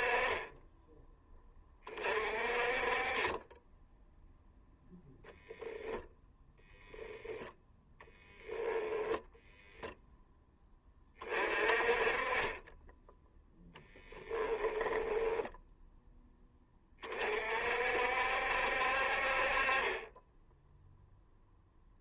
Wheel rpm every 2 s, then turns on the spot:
10, 30, 0, 10, 10, 20, 20, 20, 20, 60, 0.
8-10 14-16